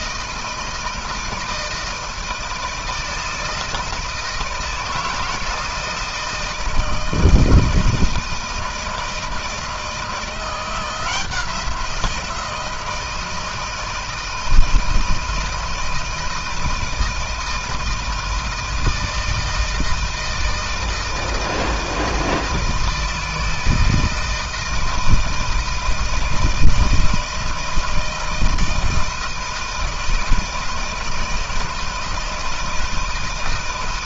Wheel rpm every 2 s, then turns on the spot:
160, 160, 160, 160, 160, 170, 170, 160, 160, 160, 160, 160, 160, 160, 160, 160, 160.
none